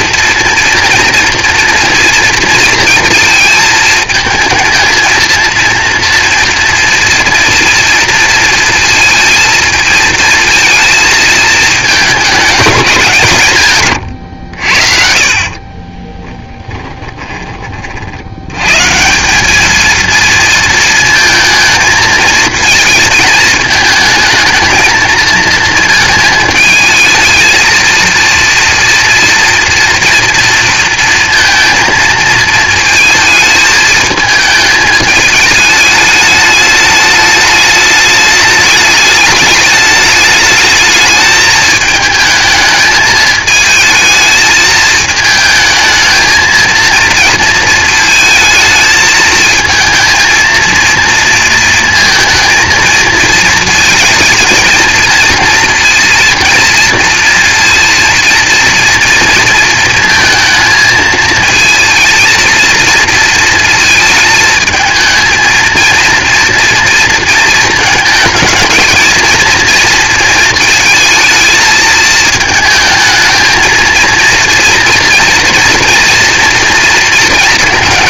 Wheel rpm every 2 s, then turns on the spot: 230, 230, 220, 230, 230, 230, 210, 60, 20, 140, 230, 220, 220, 220, 230, 230, 230, 220, 210, 210, 220, 220, 220, 220, 220, 230, 230, 230, 230, 230, 220, 230, 220, 230, 230, 220, 220, 230, 230.
16-18